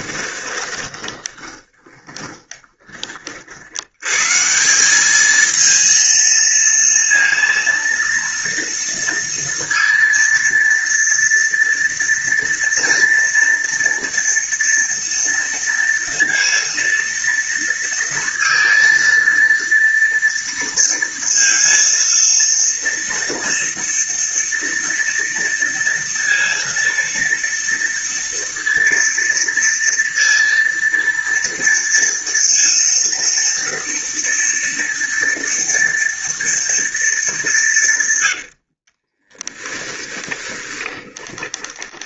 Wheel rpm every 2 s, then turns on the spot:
20, 30, 190, 230, 230, 230, 230, 230, 230, 230, 230, 240, 230, 230, 230, 230, 230, 230, 220, 30, 20.
0-2 38-42